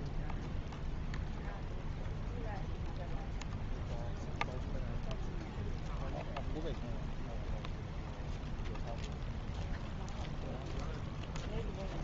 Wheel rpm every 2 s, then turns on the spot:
0, 0, 0, 0, 0, 0.
none